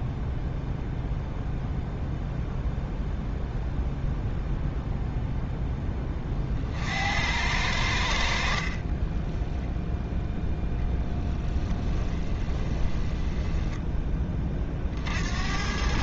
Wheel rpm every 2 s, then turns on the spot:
0, 0, 0, 50, 50, 0, 10, 30.
8-10 12-14